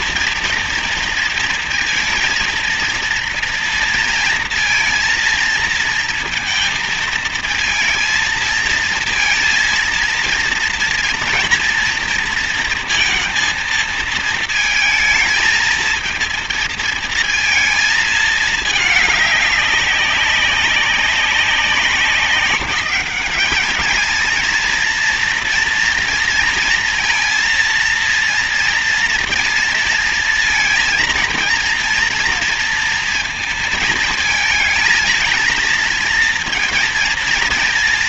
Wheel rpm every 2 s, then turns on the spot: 230, 230, 230, 220, 230, 230, 230, 230, 230, 210, 190, 200, 230, 230, 230, 230, 230, 220, 230.
none